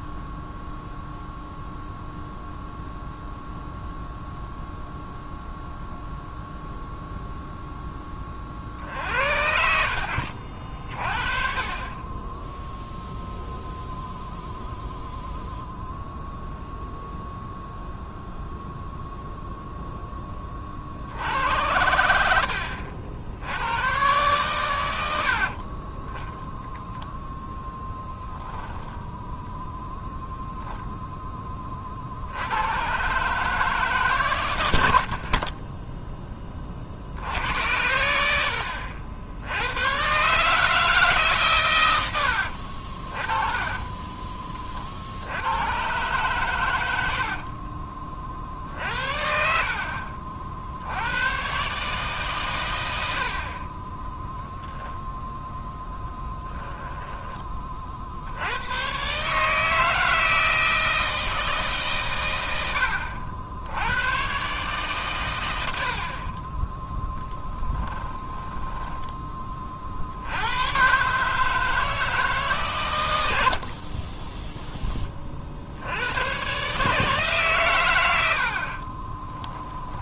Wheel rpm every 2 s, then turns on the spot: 0, 0, 0, 0, 50, 50, 0, 0, 0, 0, 40, 70, 100, 0, 10, 0, 120, 80, 40, 70, 150, 50, 40, 100, 60, 60, 100, 0, 10, 110, 160, 90, 140, 20, 10, 120, 150, 10, 150, 40.
28-30 42-44 56-58 62-64 68-70 78-80